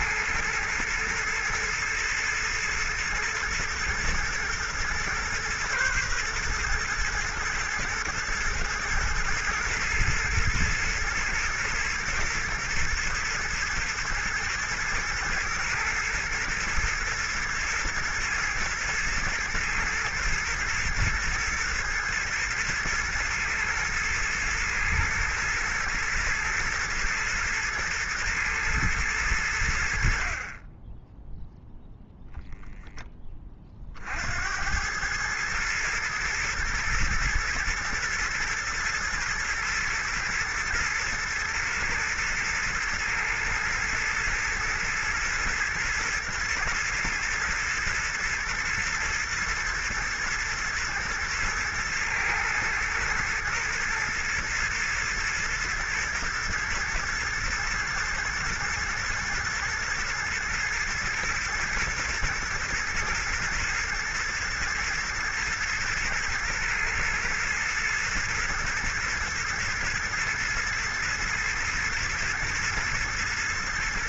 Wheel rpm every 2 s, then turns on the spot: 120, 110, 120, 120, 120, 110, 110, 120, 120, 120, 120, 110, 110, 110, 110, 30, 10, 100, 110, 120, 110, 110, 120, 110, 120, 110, 110, 110, 110, 110, 120, 110, 110, 120, 110, 110, 120.
none